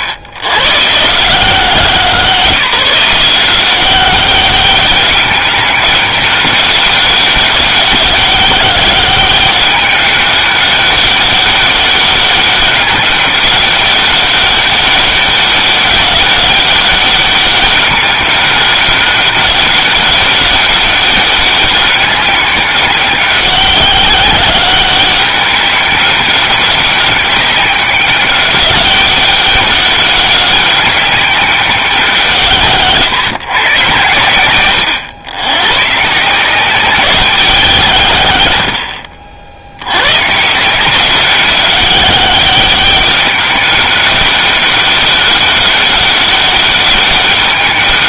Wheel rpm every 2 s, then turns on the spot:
120, 170, 190, 200, 200, 200, 200, 200, 200, 200, 200, 200, 190, 200, 200, 200, 150, 100, 190, 90, 170, 200, 200, 200.
none